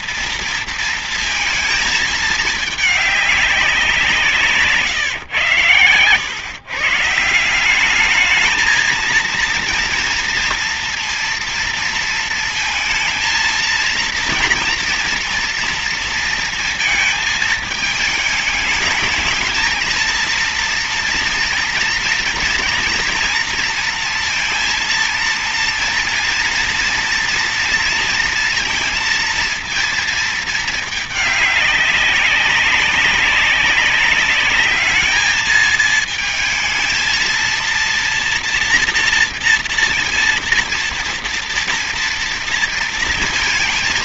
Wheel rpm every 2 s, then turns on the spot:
230, 210, 150, 130, 220, 230, 220, 230, 230, 210, 230, 230, 230, 230, 230, 220, 200, 210, 220, 230, 230, 230.
none